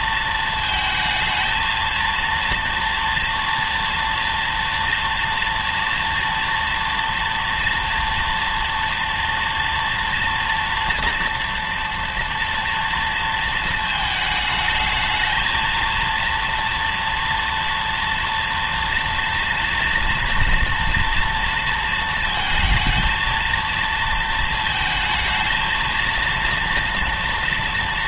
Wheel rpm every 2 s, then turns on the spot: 220, 230, 230, 230, 230, 230, 230, 210, 230, 230, 230, 220, 220, 230.
none